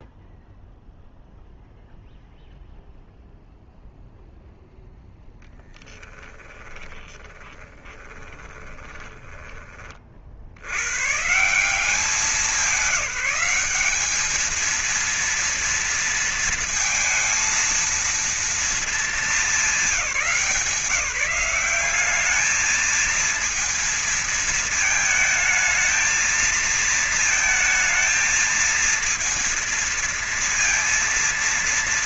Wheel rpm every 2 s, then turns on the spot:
0, 0, 0, 20, 20, 80, 180, 220, 230, 230, 180, 210, 220, 220, 220, 230.
6-10